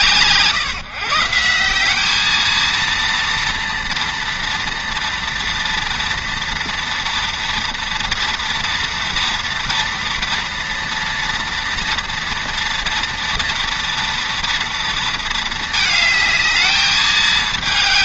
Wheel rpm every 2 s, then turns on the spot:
150, 220, 230, 230, 230, 230, 240, 230, 220.
none